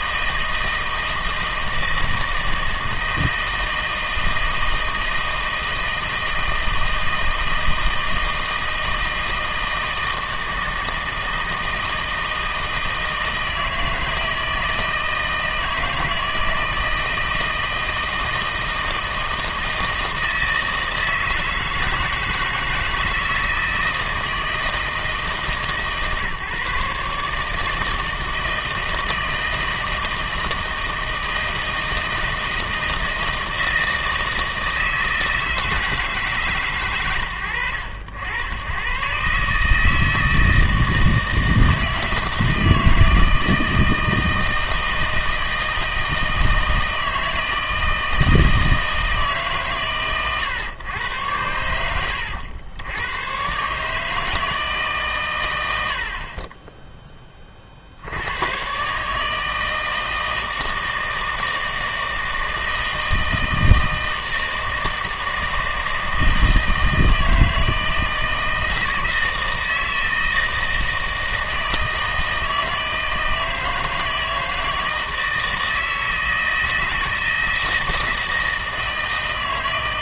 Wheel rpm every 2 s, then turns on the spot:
160, 160, 160, 160, 160, 160, 160, 160, 160, 160, 160, 160, 160, 150, 160, 160, 160, 160, 140, 100, 160, 160, 160, 160, 160, 120, 80, 160, 20, 130, 160, 160, 160, 160, 160, 160, 160, 160, 160, 160.
56-58